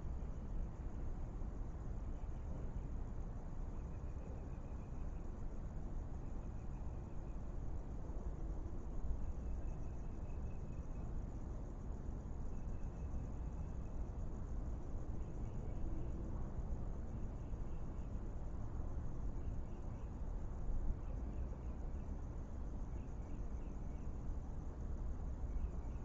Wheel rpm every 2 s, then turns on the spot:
0, 0, 0, 0, 0, 0, 0, 0, 0, 0, 0, 0, 0.
none